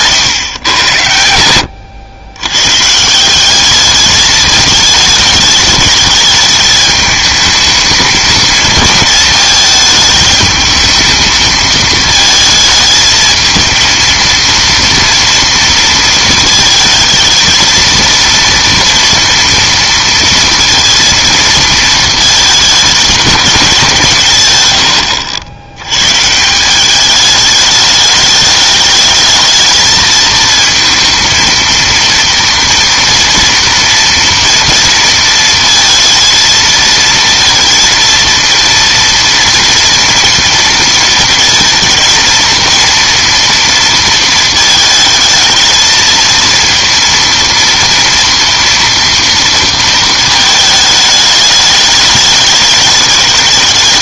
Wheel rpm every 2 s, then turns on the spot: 130, 120, 210, 210, 220, 220, 220, 230, 220, 230, 230, 220, 130, 170, 210, 230, 230, 230, 230, 230, 230, 230, 220, 230, 230, 220, 210.
none